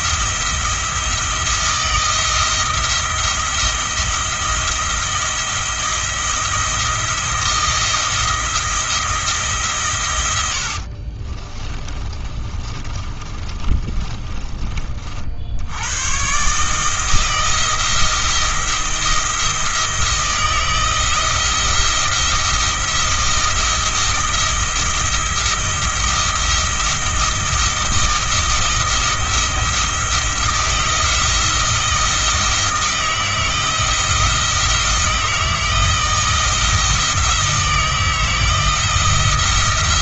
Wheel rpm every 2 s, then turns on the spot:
170, 170, 170, 170, 170, 60, 30, 40, 150, 170, 160, 170, 170, 170, 160, 170, 160, 170, 160, 170.
10-14